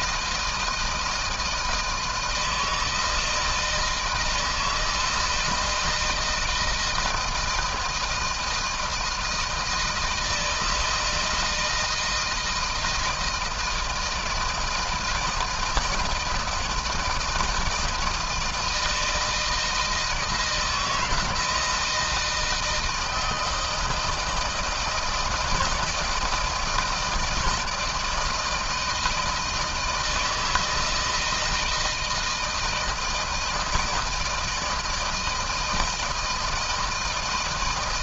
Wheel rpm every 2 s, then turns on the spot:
160, 160, 160, 160, 160, 160, 160, 160, 160, 160, 160, 160, 160, 170, 160, 160, 160, 160, 160.
none